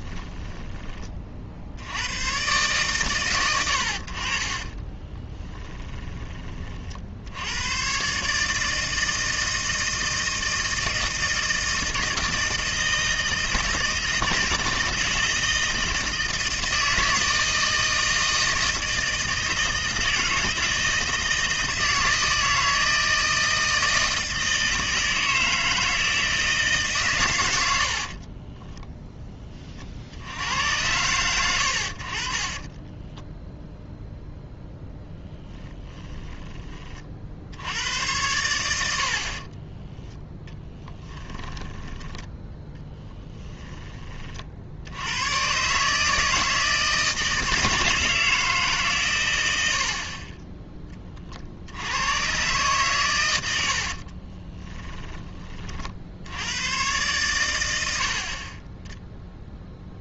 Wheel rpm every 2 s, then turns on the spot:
20, 130, 30, 40, 160, 160, 160, 160, 160, 160, 160, 160, 160, 140, 0, 100, 20, 0, 30, 80, 10, 10, 70, 160, 150, 20, 120, 20, 110, 20.
4-6 32-34 40-42 54-56